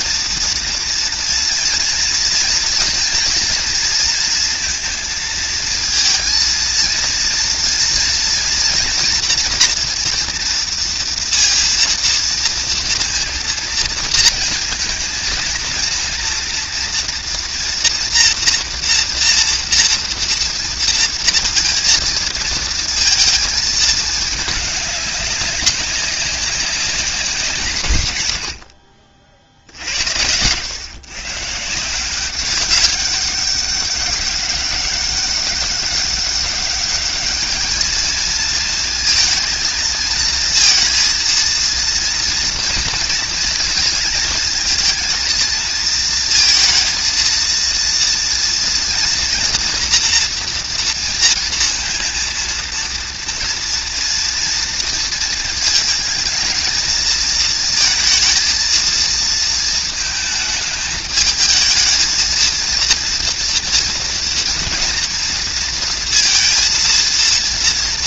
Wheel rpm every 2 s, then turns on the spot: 230, 230, 230, 230, 230, 240, 230, 230, 240, 240, 230, 230, 210, 190, 80, 90, 190, 190, 200, 230, 230, 230, 220, 220, 230, 240, 230, 240, 230, 230, 220, 230, 230, 230.
none